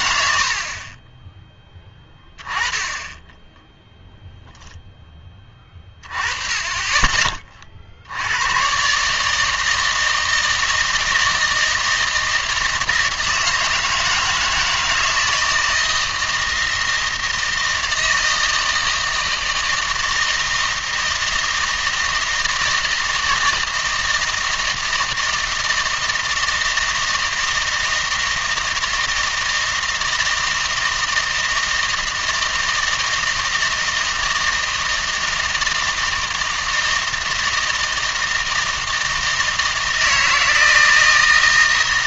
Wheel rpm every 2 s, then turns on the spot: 60, 10, 0, 20, 130, 160, 160, 160, 160, 160, 160, 160, 160, 160, 160, 160, 160, 160, 160, 160, 160.
none